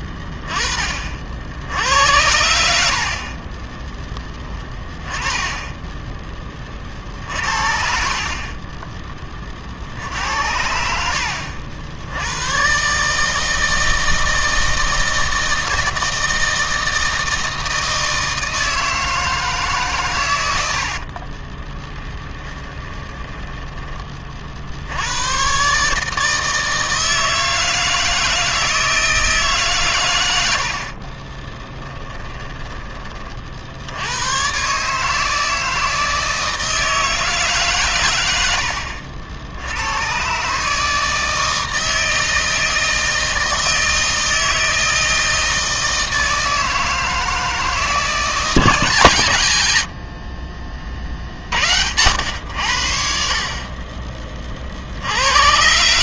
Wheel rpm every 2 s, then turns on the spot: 10, 80, 10, 20, 40, 80, 100, 160, 160, 160, 100, 10, 50, 160, 160, 90, 10, 120, 160, 80, 130, 160, 160, 160, 160, 40, 90, 40.
22-24 30-34 38-40